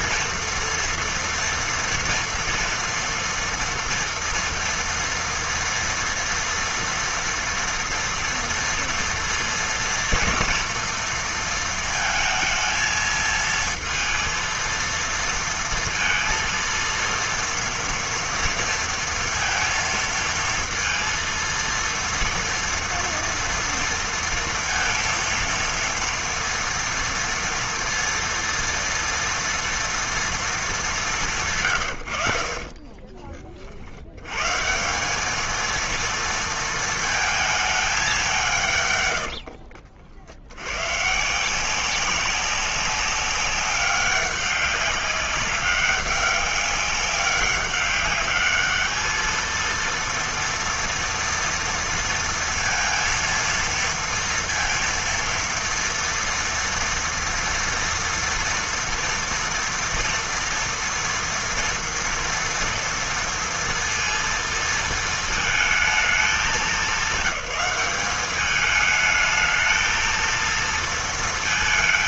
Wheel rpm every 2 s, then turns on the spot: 230, 230, 240, 230, 230, 240, 220, 230, 230, 230, 230, 230, 230, 230, 230, 210, 50, 140, 230, 150, 100, 200, 200, 200, 210, 230, 230, 230, 230, 230, 230, 230, 230, 190, 210, 230.
none